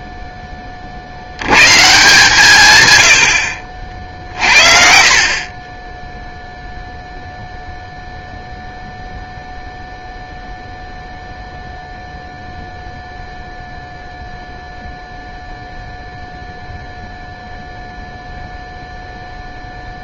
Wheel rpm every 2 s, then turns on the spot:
50, 110, 50, 0, 0, 0, 0, 0, 0, 0.
none